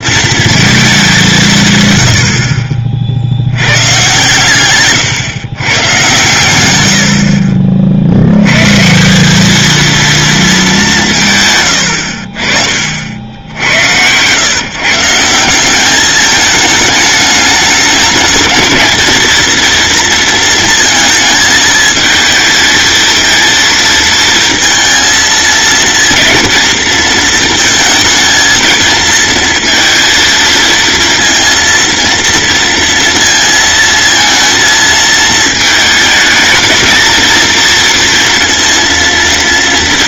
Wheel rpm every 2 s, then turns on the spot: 220, 50, 130, 80, 160, 190, 60, 140, 210, 220, 230, 220, 230, 230, 230, 230, 230, 230, 220, 230.
none